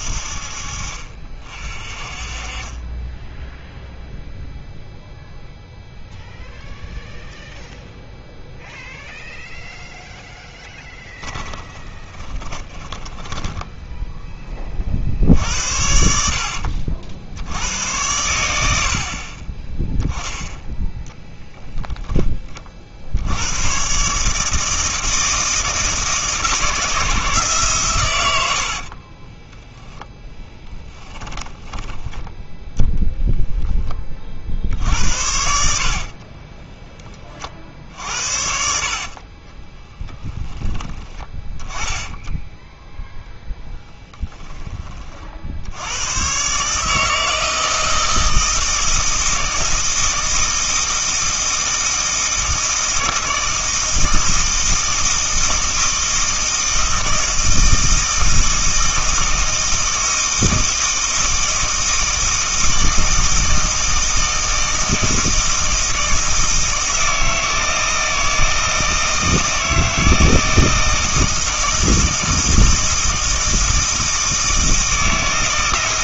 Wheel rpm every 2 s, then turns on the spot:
60, 30, 0, 0, 0, 10, 20, 20, 60, 80, 0, 30, 160, 160, 60, 10, 10, 70, 20, 60, 20, 10, 20, 140, 160, 160, 160, 160, 160, 160, 160, 160, 160, 160, 160, 160, 160, 160.
10-14 28-32 36-38